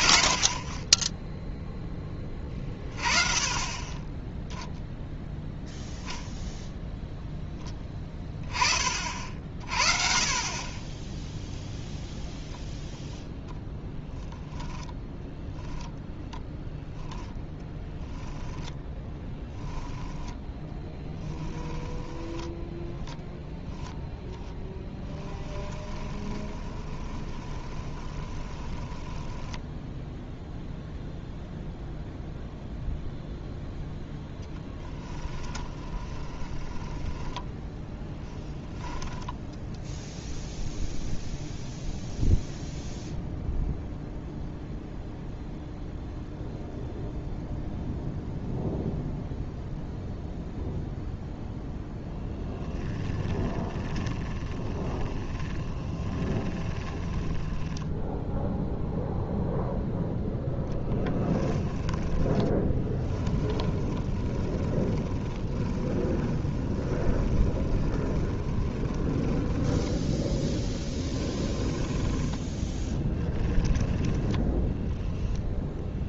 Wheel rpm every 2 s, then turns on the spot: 30, 30, 0, 0, 20, 30, 0, 10, 10, 10, 10, 0, 10, 30, 20, 0, 0, 10, 20, 10, 0, 0, 0, 0, 0, 0, 10, 20, 20, 0, 10, 10, 20, 20, 30, 10, 10, 10.
14-16 18-22 24-30 34-40 52-58 60-74